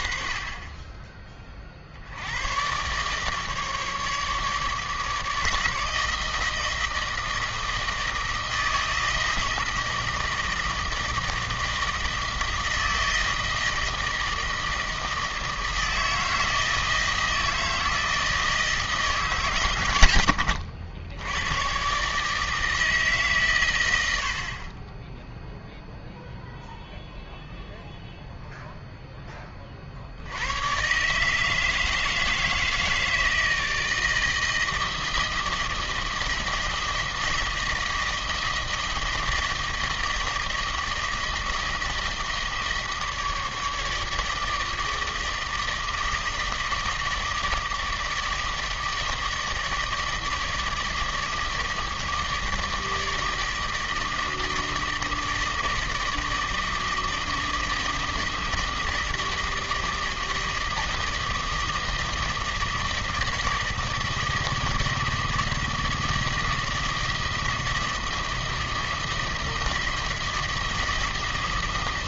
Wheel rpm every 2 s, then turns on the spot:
20, 130, 150, 160, 160, 160, 160, 160, 160, 150, 90, 150, 10, 0, 10, 140, 160, 160, 160, 160, 160, 160, 160, 160, 160, 160, 160, 160, 160, 160, 160, 160, 160, 160, 160, 160.
none